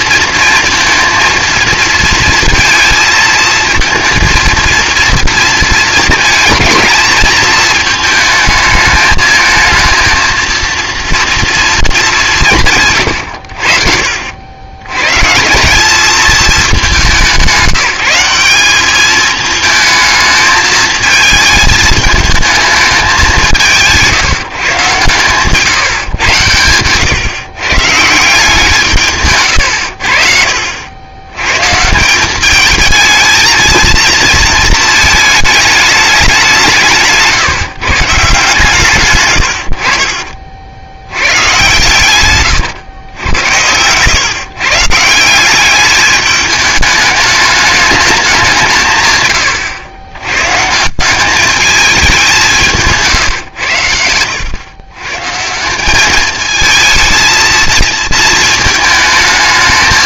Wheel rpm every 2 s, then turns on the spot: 230, 230, 230, 220, 220, 230, 150, 90, 210, 200, 220, 220, 140, 110, 170, 70, 210, 230, 170, 150, 60, 120, 140, 210, 170, 150, 150, 110, 220, 210.
none